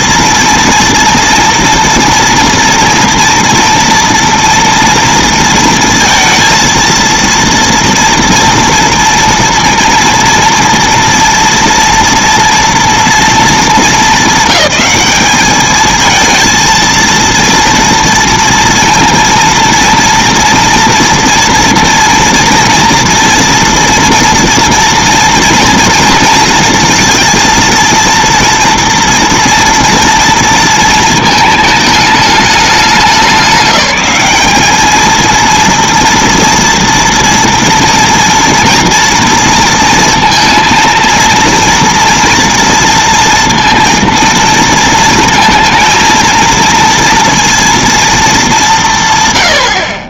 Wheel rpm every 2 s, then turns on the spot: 240, 230, 230, 230, 230, 230, 240, 200, 220, 230, 230, 230, 230, 230, 230, 230, 210, 210, 230, 230, 230, 230, 230, 230, 180.
none